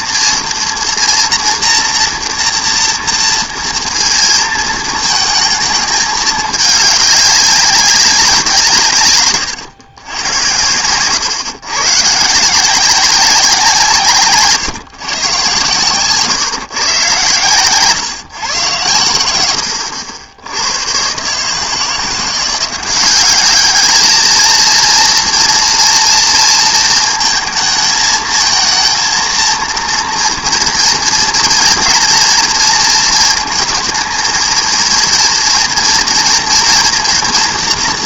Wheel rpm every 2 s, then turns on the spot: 230, 230, 220, 210, 170, 110, 170, 140, 130, 130, 90, 180, 230, 230, 230, 230, 230, 230, 230.
none